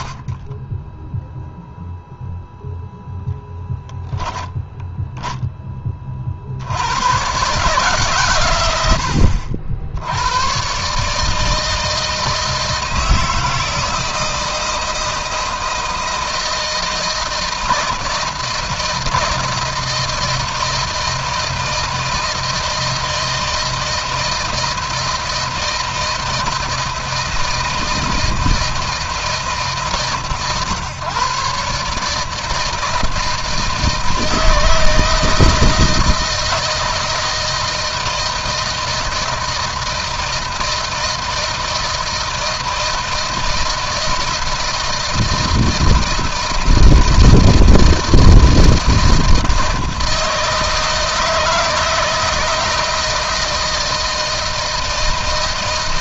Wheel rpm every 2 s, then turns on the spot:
20, 0, 10, 80, 100, 130, 160, 160, 160, 160, 160, 160, 160, 160, 160, 130, 160, 160, 160, 160, 160, 160, 160, 160, 160, 160, 160, 160.
4-6